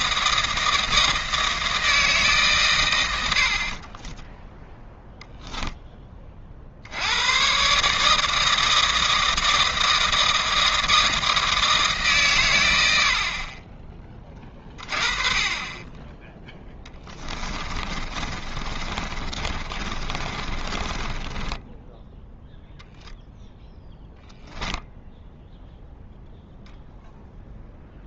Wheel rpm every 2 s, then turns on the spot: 160, 120, 0, 60, 160, 160, 90, 30, 10, 40, 20, 0, 10, 0.
16-22